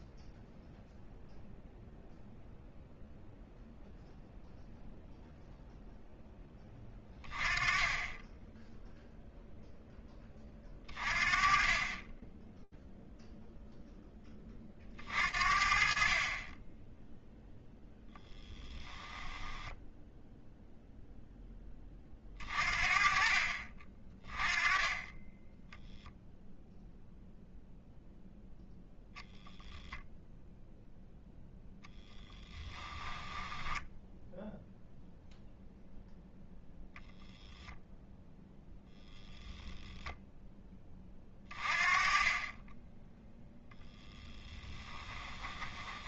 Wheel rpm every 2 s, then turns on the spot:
0, 0, 0, 20, 0, 30, 0, 50, 0, 10, 20, 40, 10, 0, 0, 0, 10, 0, 0, 0, 30, 0, 10.
18-20 32-34 44-46